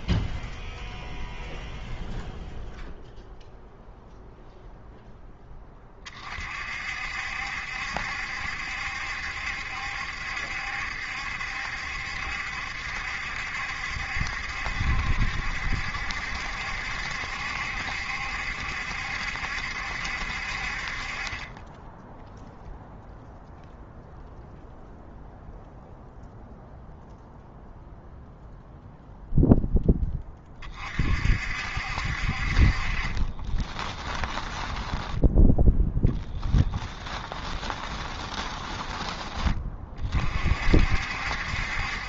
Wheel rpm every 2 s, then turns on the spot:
0, 0, 0, 50, 70, 70, 70, 70, 70, 70, 40, 0, 0, 0, 0, 40, 30, 10, 20, 20, 60.
34-40